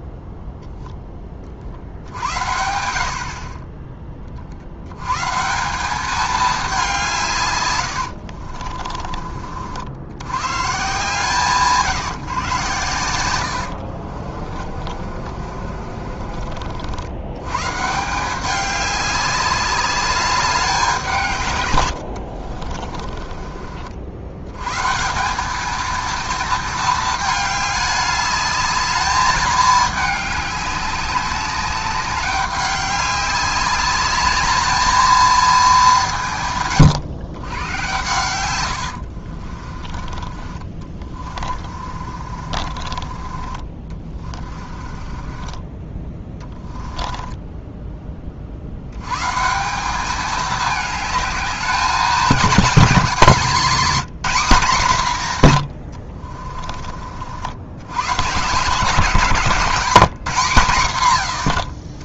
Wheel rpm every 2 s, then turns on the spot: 10, 70, 100, 190, 40, 150, 110, 40, 70, 200, 180, 40, 150, 220, 210, 200, 200, 220, 120, 80, 30, 40, 30, 20, 70, 210, 210, 190, 40, 160, 160.
8-10 12-16 22-24 38-48